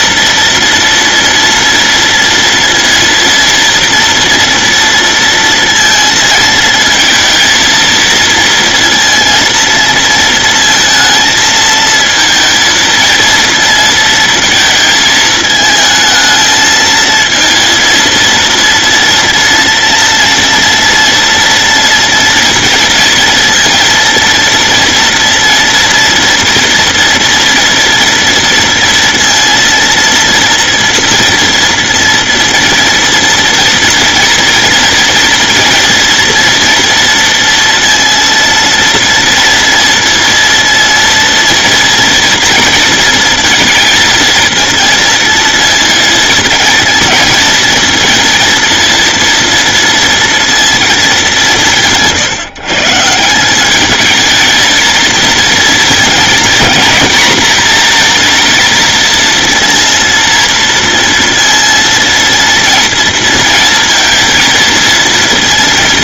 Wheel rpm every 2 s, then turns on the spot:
230, 230, 230, 230, 230, 220, 230, 220, 220, 230, 230, 230, 230, 230, 230, 230, 230, 230, 230, 230, 230, 230, 230, 220, 230, 230, 140, 220, 230, 230, 230, 230, 220.
none